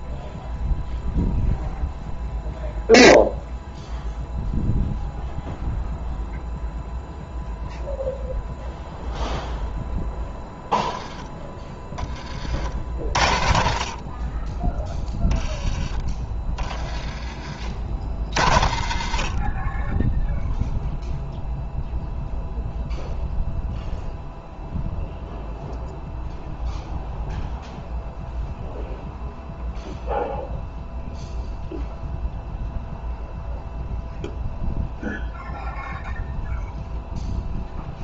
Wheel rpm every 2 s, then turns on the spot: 0, 0, 0, 0, 0, 10, 60, 10, 30, 50, 0, 0, 0, 0, 0, 0, 0, 0, 0.
none